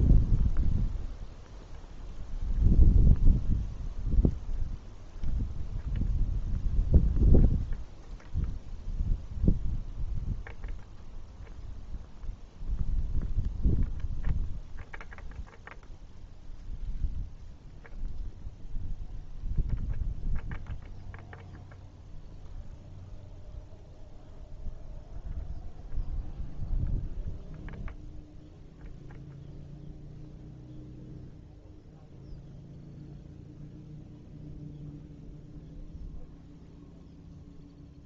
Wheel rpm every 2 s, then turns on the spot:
0, 0, 0, 0, 0, 0, 0, 0, 0, 0, 0, 0, 0, 0, 0, 0, 0, 0, 0.
none